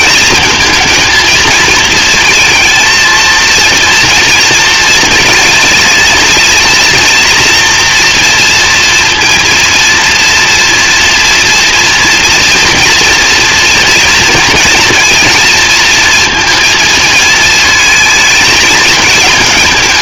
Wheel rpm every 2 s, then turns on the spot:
230, 230, 230, 230, 230, 230, 230, 230, 230, 220.
none